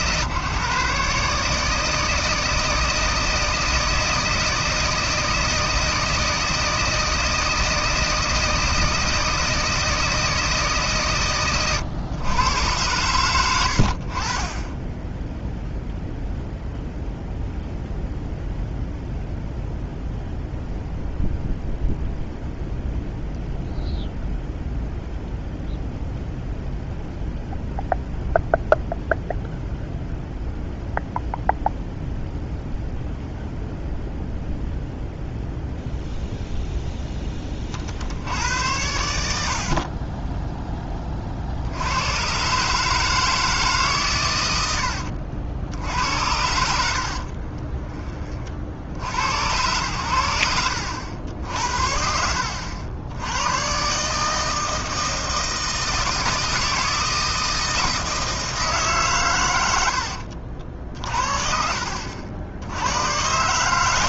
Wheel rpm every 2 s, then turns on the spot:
140, 160, 160, 160, 160, 140, 110, 10, 0, 0, 0, 0, 0, 0, 0, 0, 0, 0, 0, 80, 20, 150, 90, 70, 60, 80, 80, 160, 160, 140, 50, 100.
44-48